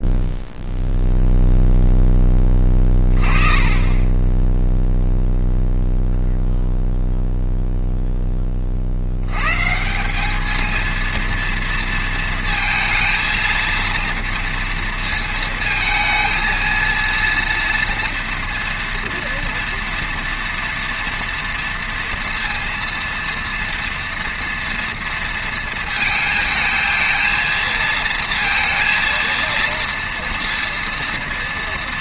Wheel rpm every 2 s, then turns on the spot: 0, 20, 10, 0, 30, 210, 230, 230, 230, 230, 230, 230, 230, 220, 230, 230.
none